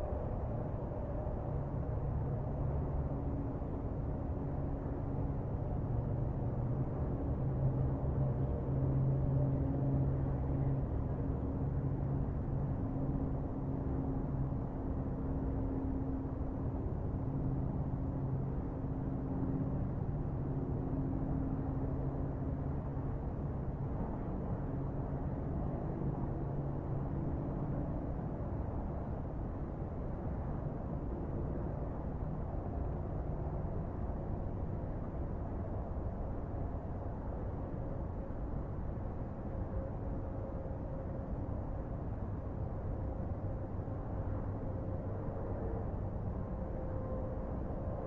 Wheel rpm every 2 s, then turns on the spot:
0, 0, 0, 0, 0, 0, 0, 0, 0, 0, 0, 0, 0, 0, 0, 0, 0, 0, 0, 0, 0, 0, 0, 0.
none